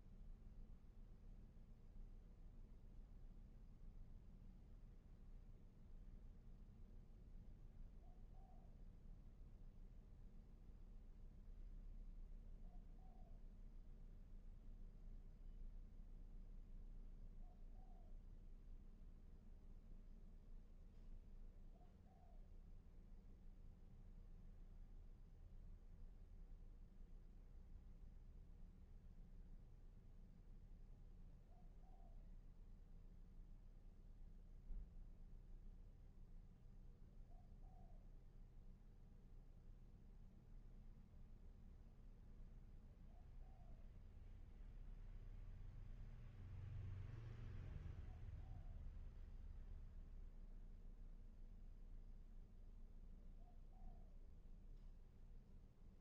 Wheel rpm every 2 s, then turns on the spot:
0, 0, 0, 0, 0, 0, 0, 0, 0, 0, 0, 0, 0, 0, 0, 0, 0, 0, 0, 0, 0, 0, 0, 0, 0, 0, 0, 0.
none